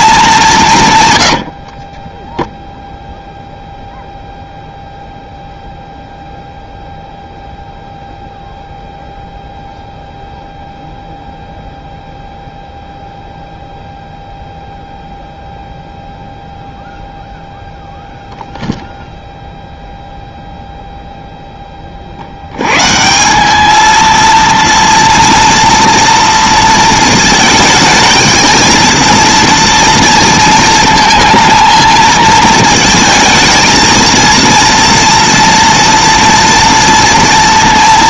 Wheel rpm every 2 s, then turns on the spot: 130, 0, 0, 0, 0, 0, 0, 0, 0, 0, 0, 110, 230, 230, 220, 230, 220, 230, 230.
none